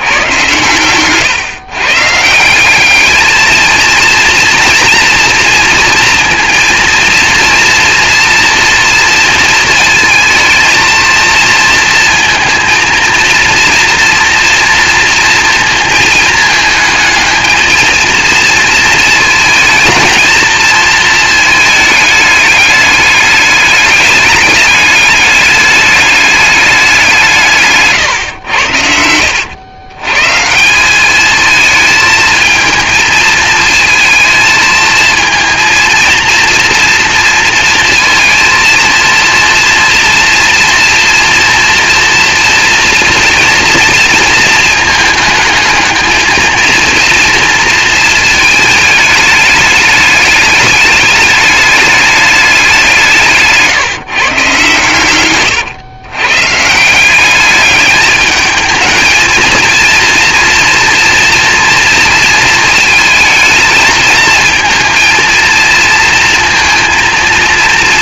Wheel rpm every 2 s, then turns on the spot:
120, 210, 230, 230, 230, 230, 230, 230, 220, 220, 220, 210, 210, 180, 90, 210, 220, 230, 230, 230, 230, 230, 220, 230, 210, 210, 160, 120, 190, 220, 240, 220, 230, 230.
none